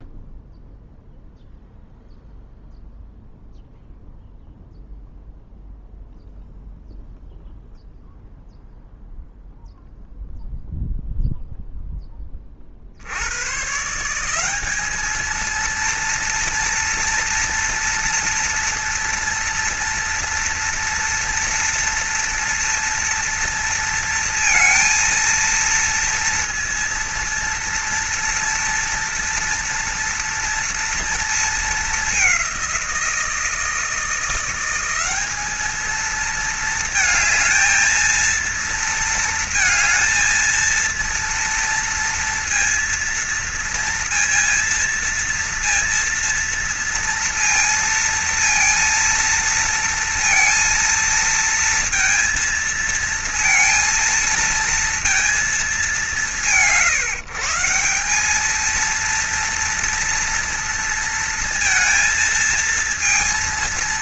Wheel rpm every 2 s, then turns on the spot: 0, 0, 0, 0, 0, 0, 60, 210, 230, 230, 230, 240, 230, 230, 230, 230, 170, 190, 220, 230, 230, 230, 230, 230, 230, 230, 230, 230, 140, 230, 230, 230.
none